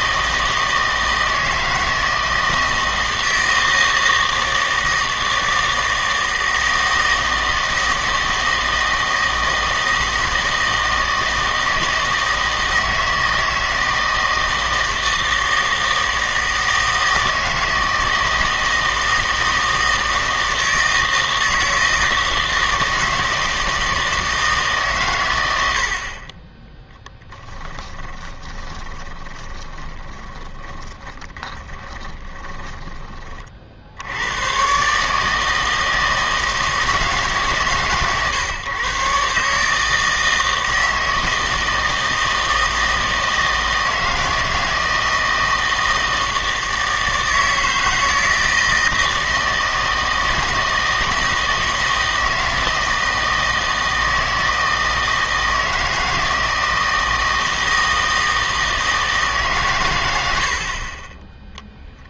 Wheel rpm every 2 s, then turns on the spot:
160, 160, 160, 160, 160, 160, 160, 160, 160, 160, 160, 160, 150, 10, 20, 20, 20, 130, 160, 130, 160, 160, 160, 160, 160, 160, 160, 160, 160, 160, 50.
28-34